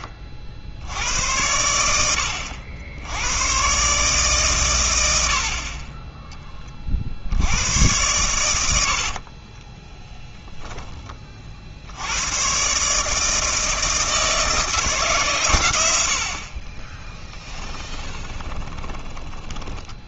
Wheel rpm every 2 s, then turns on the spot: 70, 80, 110, 30, 80, 10, 140, 160, 30, 10.
18-20